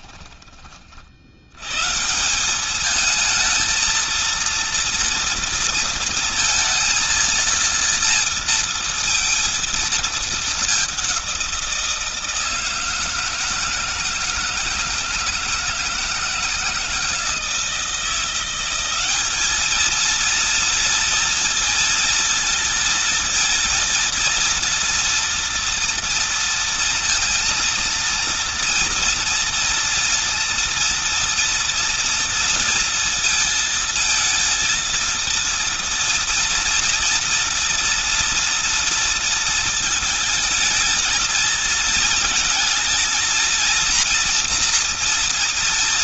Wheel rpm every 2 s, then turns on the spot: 30, 190, 230, 230, 230, 210, 160, 160, 170, 180, 230, 230, 230, 230, 230, 230, 230, 230, 230, 230, 220, 220, 230.
none